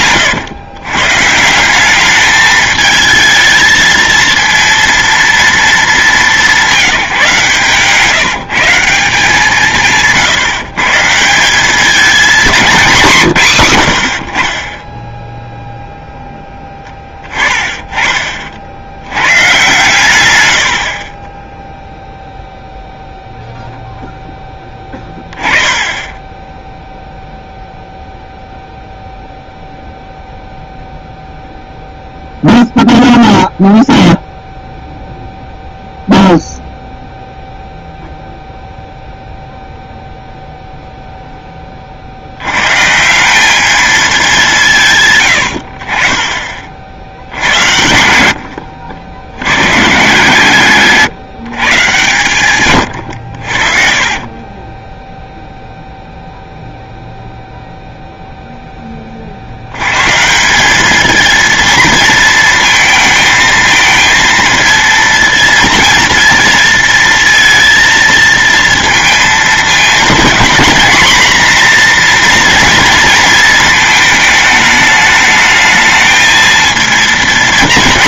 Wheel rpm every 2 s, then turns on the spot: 120, 220, 230, 190, 170, 160, 220, 30, 10, 50, 80, 0, 10, 10, 0, 0, 0, 0, 0, 0, 0, 110, 160, 50, 80, 150, 130, 20, 0, 0, 190, 220, 230, 230, 230, 230, 240, 220, 230.
48-50 52-56